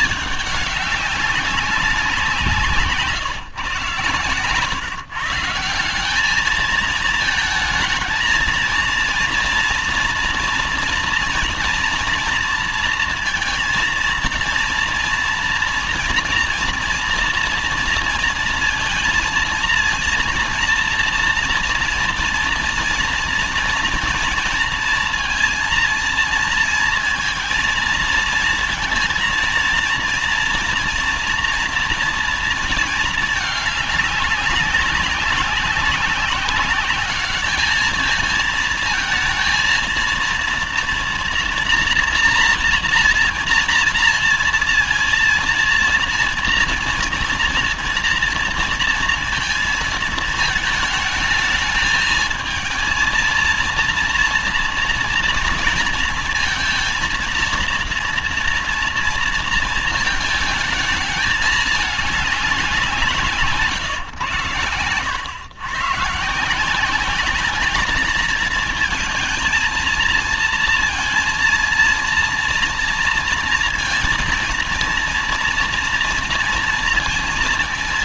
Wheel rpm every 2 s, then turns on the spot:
210, 170, 140, 210, 230, 230, 230, 230, 230, 230, 230, 230, 230, 230, 230, 240, 230, 190, 200, 220, 230, 230, 230, 230, 230, 220, 220, 230, 230, 230, 220, 190, 100, 160, 220, 230, 240, 230, 230.
none